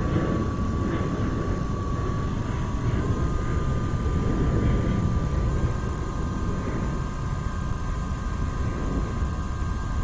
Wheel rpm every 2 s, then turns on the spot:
0, 0, 0, 0, 0.
none